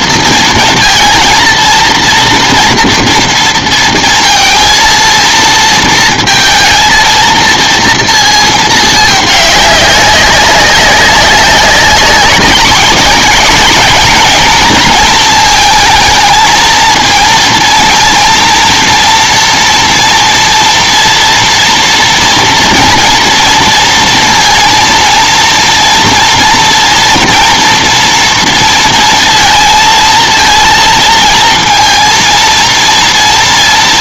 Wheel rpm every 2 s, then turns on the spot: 230, 230, 230, 220, 220, 190, 200, 220, 230, 230, 230, 230, 230, 230, 230, 230, 230.
none